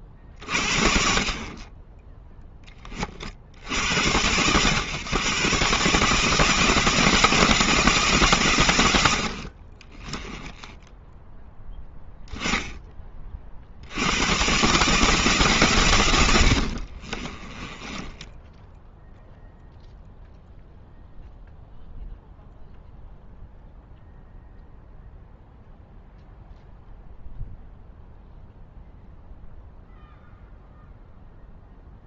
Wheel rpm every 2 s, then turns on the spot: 40, 10, 110, 160, 100, 10, 20, 140, 50, 0, 0, 0, 0, 0, 0, 0.
16-18